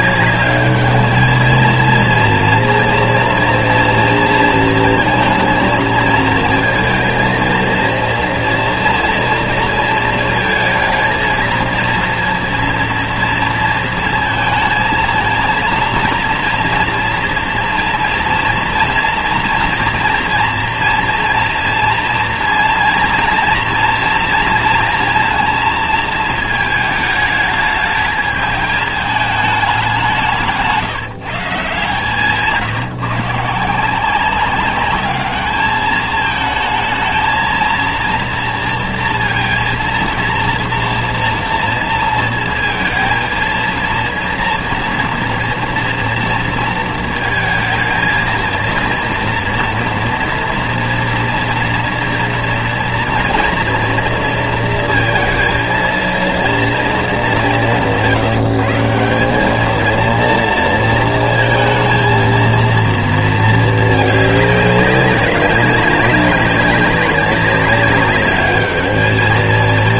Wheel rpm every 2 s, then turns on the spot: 210, 230, 230, 230, 230, 220, 240, 230, 230, 230, 230, 230, 230, 220, 210, 170, 150, 200, 220, 230, 230, 230, 230, 230, 230, 230, 230, 230, 230, 160, 230, 230, 210, 200, 210.
none